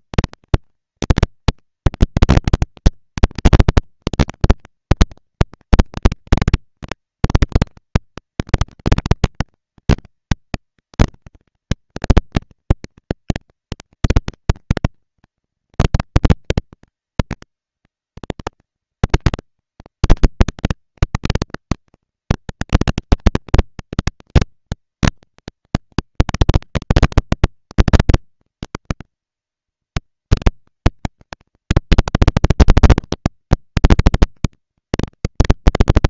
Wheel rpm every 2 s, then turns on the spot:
230, 230, 230, 230, 240, 230, 230, 230, 230, 200, 200, 230, 230, 230, 230, 230, 230, 240.
none